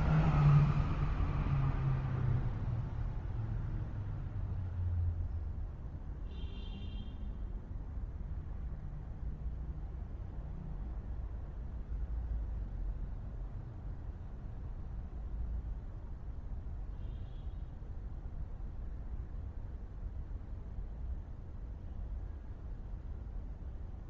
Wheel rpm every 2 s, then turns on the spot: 0, 0, 0, 0, 0, 0, 0, 0, 0, 0, 0, 0.
none